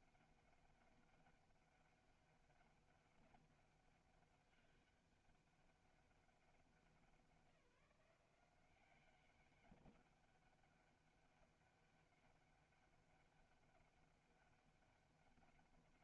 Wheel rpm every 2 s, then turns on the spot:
200, 200, 200, 190, 180, 200, 200, 200.
none